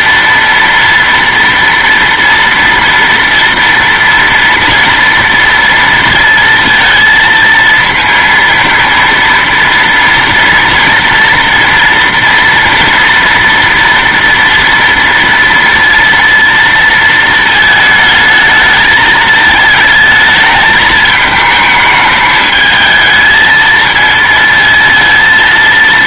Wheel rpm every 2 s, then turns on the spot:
230, 230, 230, 230, 230, 230, 230, 240, 230, 220, 220, 220, 230.
none